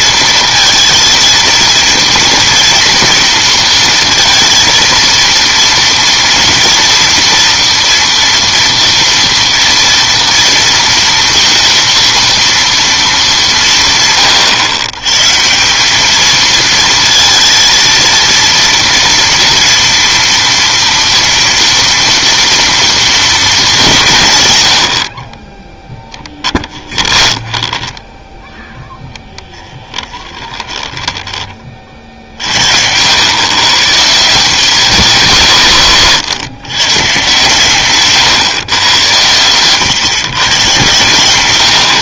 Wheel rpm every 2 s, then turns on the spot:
230, 230, 220, 230, 230, 230, 230, 120, 230, 230, 230, 240, 100, 10, 10, 20, 70, 190, 120, 130, 120.
26-28 30-32